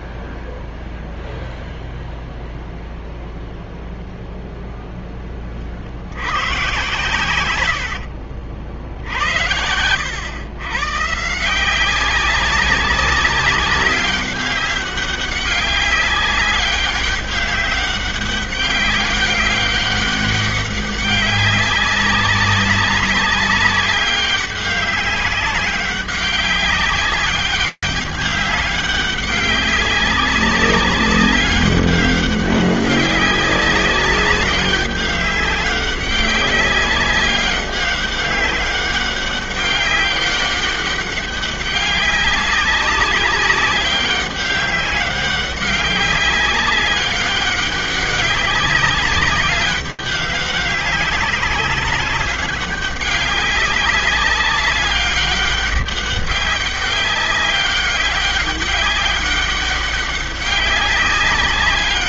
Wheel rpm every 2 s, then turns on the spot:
0, 0, 0, 100, 60, 100, 190, 190, 200, 200, 200, 200, 200, 190, 200, 190, 200, 200, 200, 200, 190, 200, 200, 200, 200, 190, 190, 200, 200, 200, 190.
none